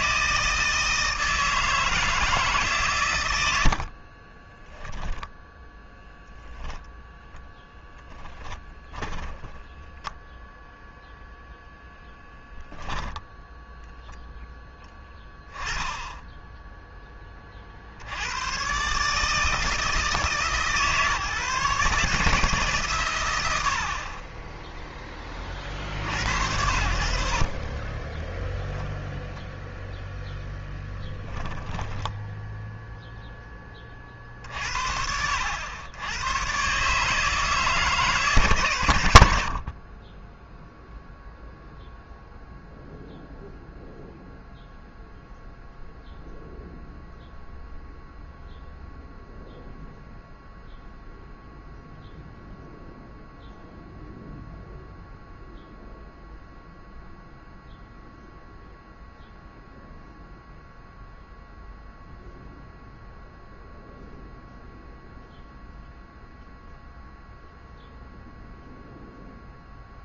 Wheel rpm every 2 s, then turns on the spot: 160, 130, 10, 0, 10, 0, 10, 10, 10, 130, 140, 140, 10, 90, 10, 10, 0, 50, 130, 100, 0, 0, 0, 0, 0, 0, 0, 0, 0, 0, 0, 0, 0, 0, 0.
4-6 8-10 12-14 28-30